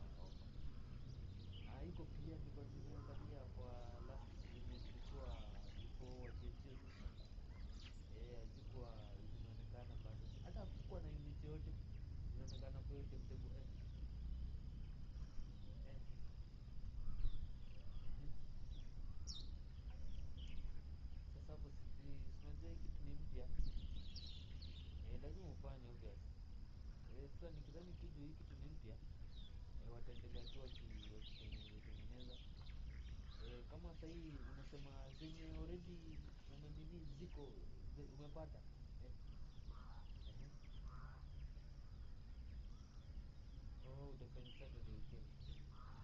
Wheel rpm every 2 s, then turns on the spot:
0, 0, 0, 0, 0, 0, 0, 0, 0, 0, 0, 0, 0, 0, 0, 0, 0, 0, 0, 0, 0, 0, 0.
none